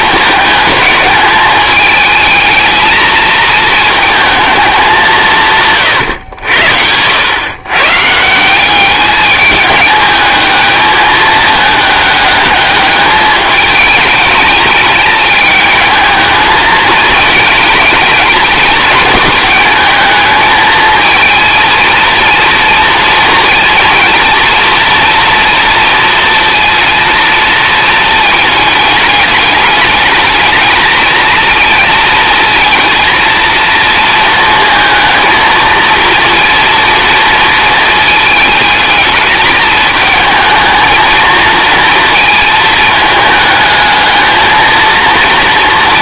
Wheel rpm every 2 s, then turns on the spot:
220, 220, 210, 80, 190, 220, 210, 210, 220, 200, 220, 240, 230, 230, 220, 220, 230, 230, 230, 220, 220, 220, 220.
none